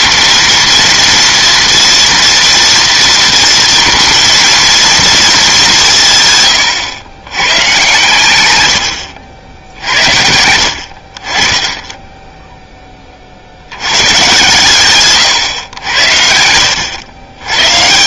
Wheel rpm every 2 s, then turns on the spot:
230, 230, 230, 110, 90, 60, 10, 120, 100.
none